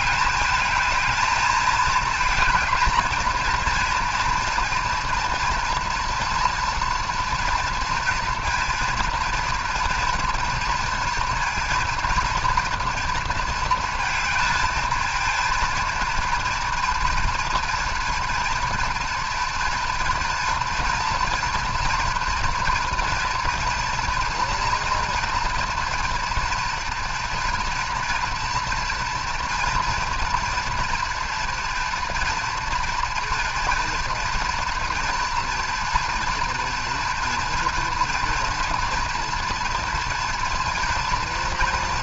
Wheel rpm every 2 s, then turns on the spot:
220, 230, 240, 230, 230, 230, 230, 220, 230, 240, 230, 230, 230, 240, 240, 240, 230, 230, 230, 240, 230.
none